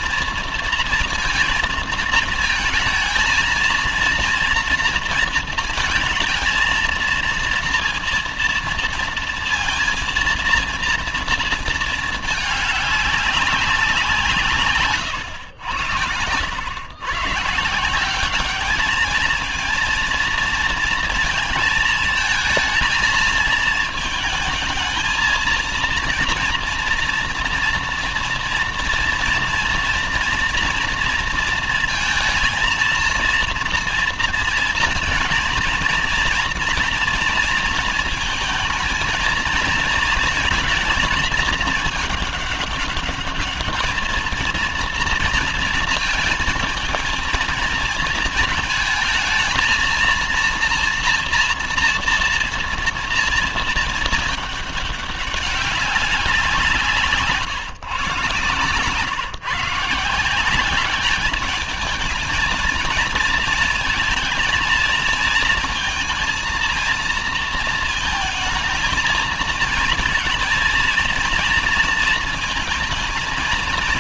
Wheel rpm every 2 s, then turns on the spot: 230, 220, 230, 230, 230, 230, 210, 160, 100, 200, 230, 220, 210, 230, 230, 240, 230, 230, 230, 220, 230, 210, 220, 220, 220, 230, 230, 220, 180, 140, 180, 220, 230, 230, 220, 230, 230.
none